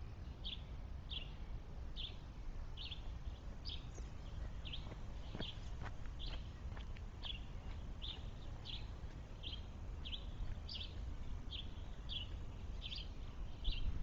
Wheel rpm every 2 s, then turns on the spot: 0, 0, 0, 0, 0, 0, 0.
none